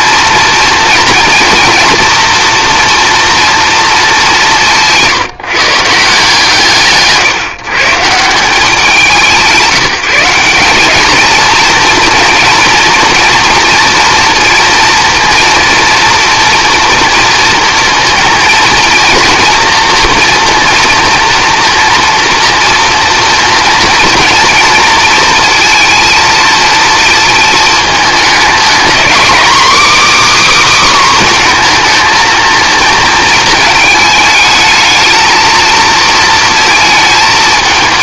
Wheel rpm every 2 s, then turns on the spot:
230, 230, 180, 150, 180, 200, 230, 230, 230, 230, 240, 230, 230, 230, 230, 290, 230, 220, 230.
none